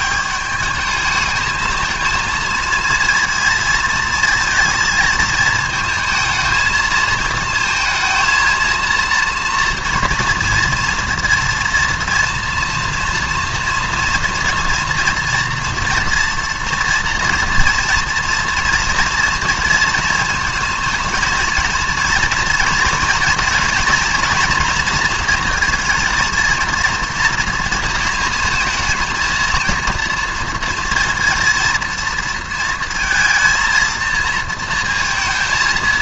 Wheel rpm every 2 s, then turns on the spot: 200, 220, 230, 220, 220, 230, 230, 230, 230, 230, 230, 240, 230, 230, 230, 230, 230, 230.
none